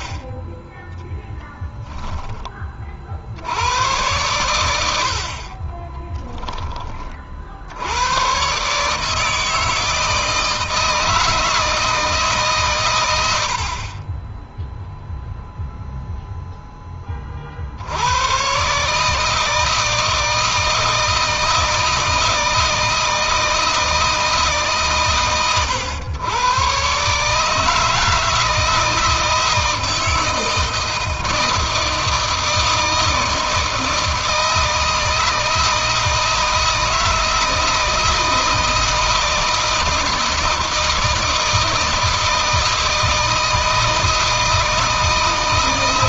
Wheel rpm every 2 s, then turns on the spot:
10, 40, 80, 30, 150, 160, 130, 0, 10, 140, 160, 160, 140, 130, 160, 160, 160, 160, 160, 160, 160, 160, 160.
none